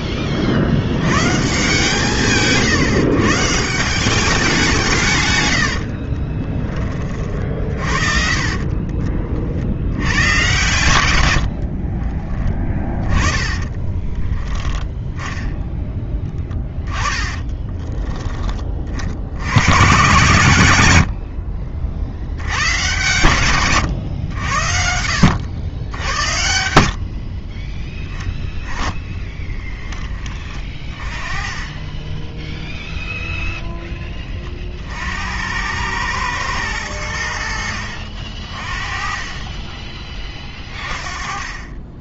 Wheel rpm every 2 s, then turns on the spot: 100, 130, 140, 30, 40, 120, 20, 10, 20, 50, 80, 120, 80, 50, 10, 30, 0, 60, 90, 30, 20.
8-10 12-14 16-18 24-26 28-30 40-42